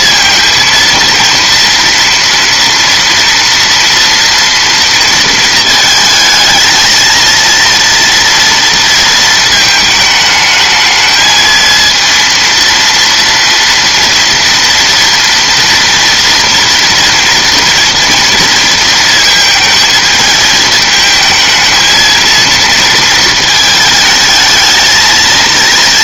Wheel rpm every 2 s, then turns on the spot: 230, 230, 230, 230, 230, 220, 230, 230, 230, 230, 220, 230, 220.
none